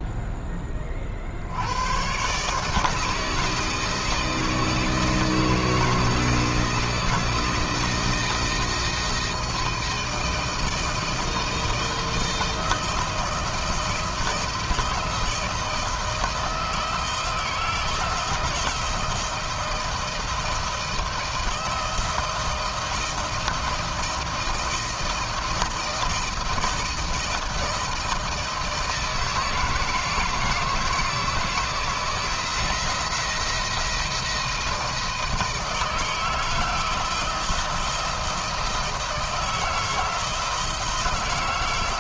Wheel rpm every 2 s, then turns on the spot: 40, 160, 160, 170, 160, 170, 160, 160, 160, 170, 160, 170, 170, 160, 160, 160, 170, 160, 160, 160, 160.
none